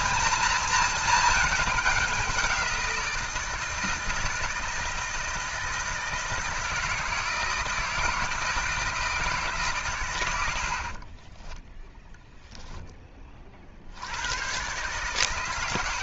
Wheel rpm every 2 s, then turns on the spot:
220, 180, 160, 160, 160, 80, 0, 120.
none